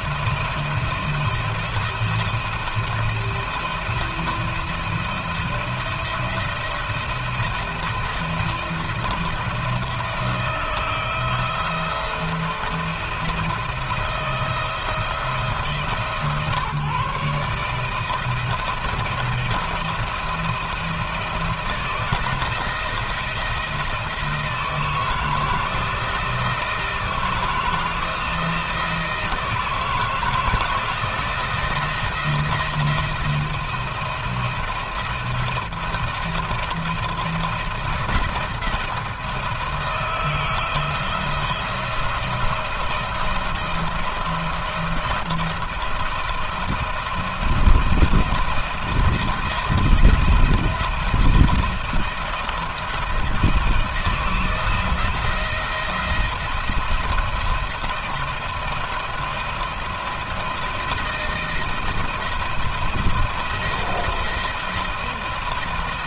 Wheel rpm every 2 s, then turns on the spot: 170, 170, 170, 170, 170, 160, 170, 170, 150, 160, 170, 170, 160, 160, 160, 170, 170, 170, 170, 170, 160, 170, 170, 170, 170, 170, 170, 170, 170, 170, 170, 160, 170.
none